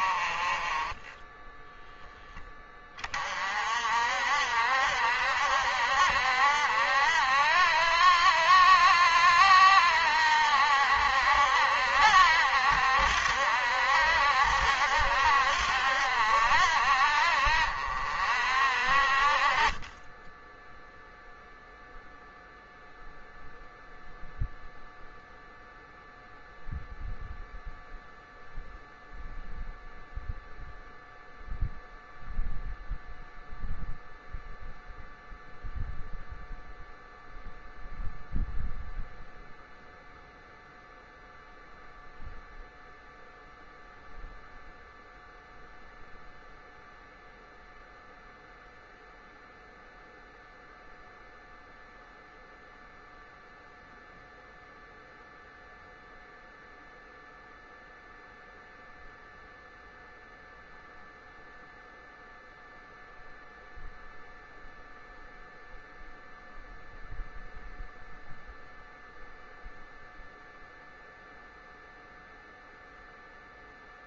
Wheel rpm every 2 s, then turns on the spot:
20, 20, 70, 70, 70, 70, 70, 70, 60, 50, 0, 0, 0, 0, 0, 0, 0, 0, 0, 0, 0, 0, 0, 0, 0, 0, 0, 0, 0, 0, 0, 0, 0, 0, 0, 0, 0.
none